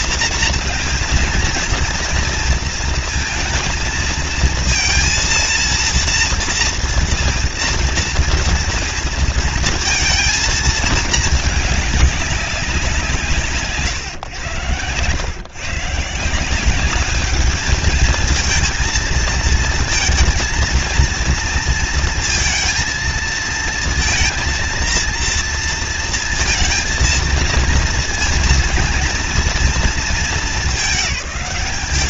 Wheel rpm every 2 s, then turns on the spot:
230, 230, 230, 230, 230, 220, 160, 120, 210, 220, 230, 220, 230, 230, 230, 210.
none